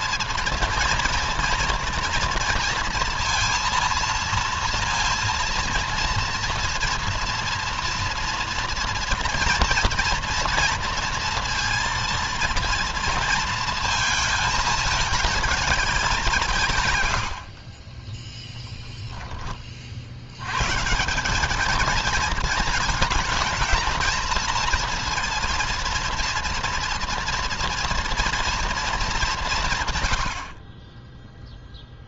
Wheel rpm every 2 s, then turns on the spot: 230, 230, 230, 230, 230, 240, 230, 220, 110, 10, 170, 220, 230, 230, 210, 20.
none